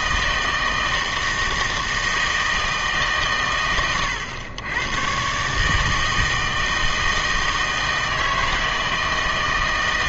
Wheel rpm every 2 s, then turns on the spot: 160, 160, 110, 160, 160.
none